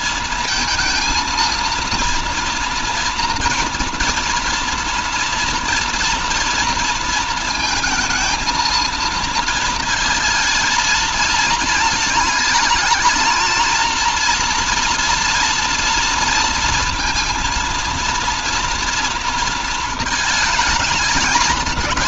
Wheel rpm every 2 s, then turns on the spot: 220, 230, 230, 230, 220, 230, 220, 230, 230, 230, 220.
none